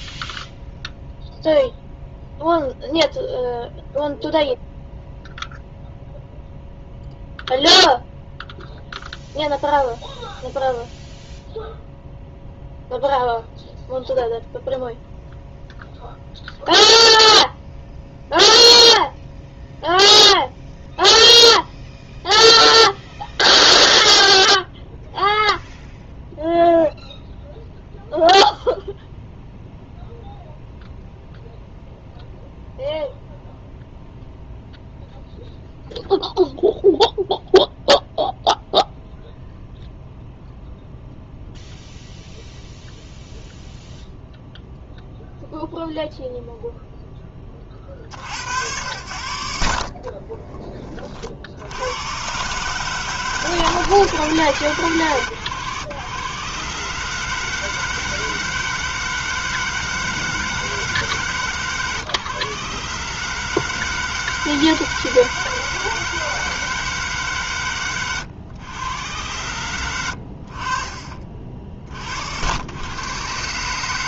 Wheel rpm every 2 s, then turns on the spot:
0, 0, 0, 0, 0, 0, 0, 0, 0, 0, 0, 0, 0, 0, 0, 0, 0, 0, 0, 0, 0, 0, 0, 0, 100, 40, 150, 130, 150, 160, 140, 140, 160, 150, 110, 40, 100.
none